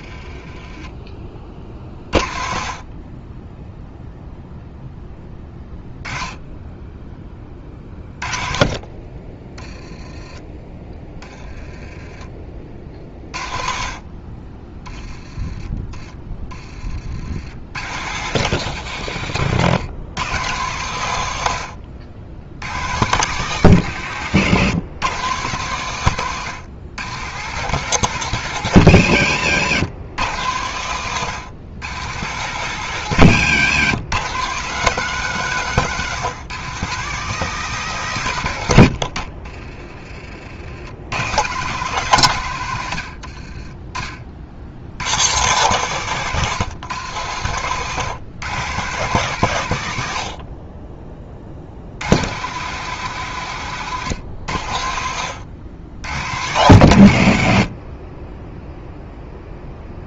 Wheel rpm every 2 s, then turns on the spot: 20, 40, 0, 10, 30, 20, 40, 20, 40, 130, 120, 120, 130, 120, 140, 110, 140, 160, 160, 90, 80, 90, 90, 140, 140, 40, 130, 90, 110, 0.
none